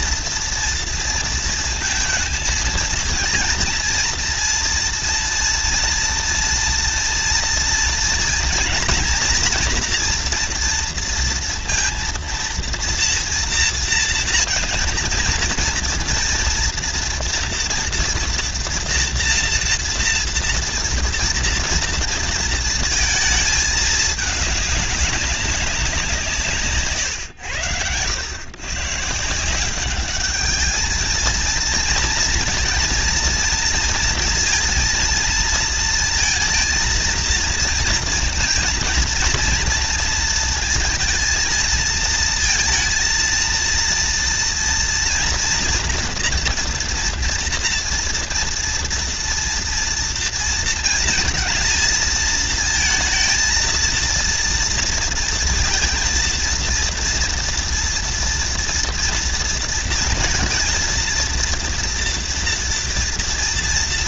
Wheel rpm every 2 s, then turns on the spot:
230, 220, 230, 230, 230, 230, 230, 230, 230, 240, 230, 230, 210, 150, 130, 210, 230, 230, 230, 230, 230, 220, 230, 240, 230, 230, 220, 230, 230, 240, 230, 230.
none